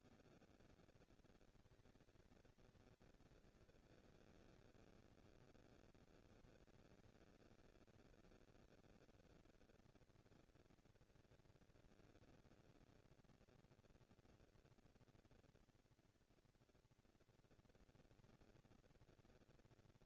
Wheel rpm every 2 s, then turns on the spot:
230, 220, 230, 220, 230, 230, 230, 230, 230, 220.
none